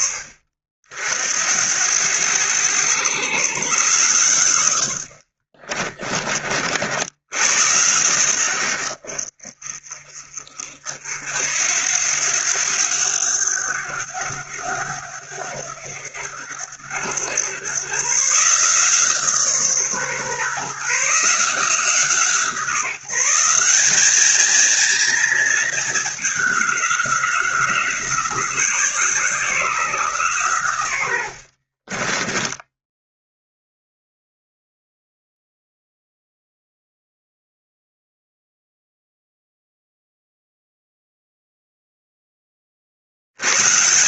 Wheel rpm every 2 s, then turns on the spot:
60, 100, 90, 60, 80, 60, 90, 100, 90, 150, 140, 180, 230, 200, 170, 110, 10, 0, 0, 0, 0, 40.
32-34